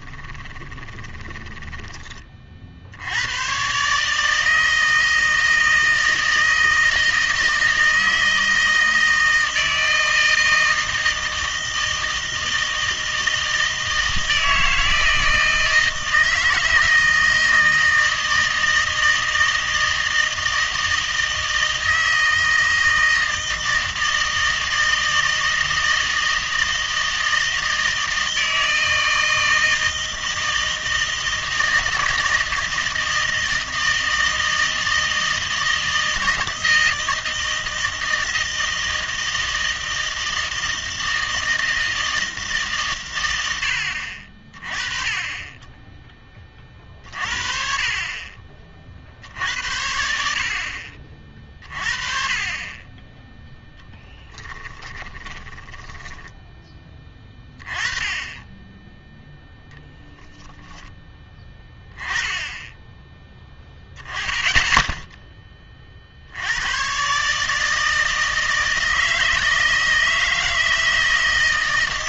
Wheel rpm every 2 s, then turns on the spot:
20, 60, 160, 160, 160, 160, 160, 160, 160, 160, 160, 160, 160, 160, 160, 160, 160, 160, 160, 160, 160, 140, 20, 30, 50, 60, 30, 10, 10, 10, 20, 10, 10, 100, 160, 160.
0-2 54-56